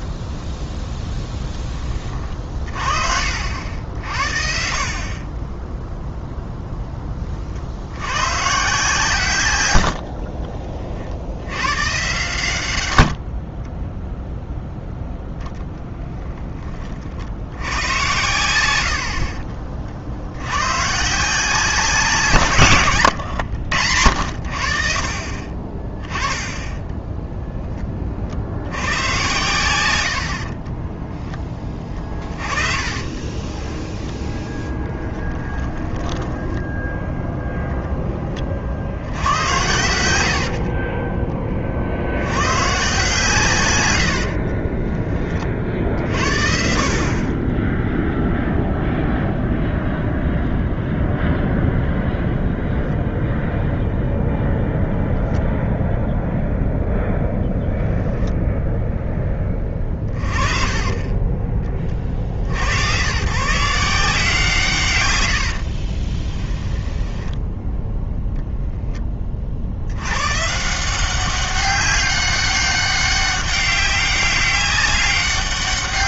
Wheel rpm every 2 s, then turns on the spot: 10, 40, 50, 10, 140, 40, 100, 0, 20, 70, 120, 140, 60, 10, 80, 20, 30, 20, 0, 60, 40, 130, 20, 50, 0, 0, 0, 0, 0, 0, 30, 90, 140, 10, 0, 160, 200, 200.
30-36 40-42 44-46 60-62 66-68